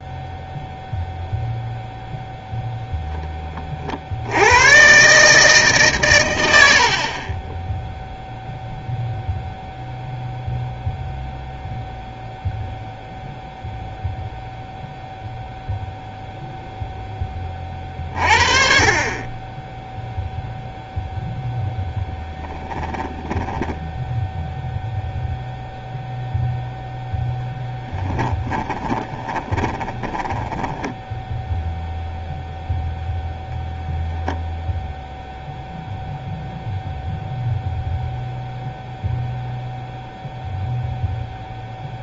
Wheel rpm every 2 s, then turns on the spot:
0, 0, 130, 70, 0, 0, 0, 0, 0, 40, 0, 10, 0, 0, 10, 10, 0, 0, 0, 0, 0.
22-24 28-32